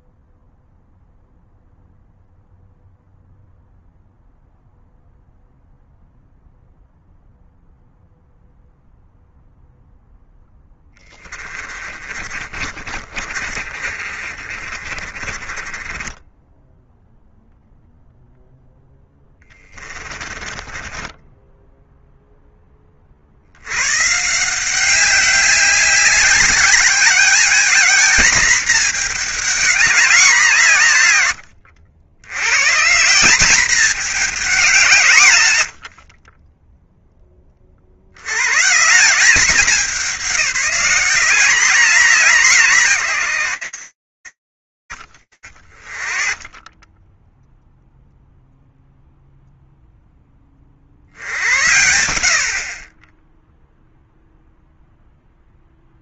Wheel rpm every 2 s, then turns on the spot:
0, 0, 0, 0, 0, 20, 40, 30, 0, 10, 10, 100, 190, 220, 200, 90, 210, 60, 120, 180, 190, 80, 20, 0, 0, 70, 0, 10.
10-16 18-22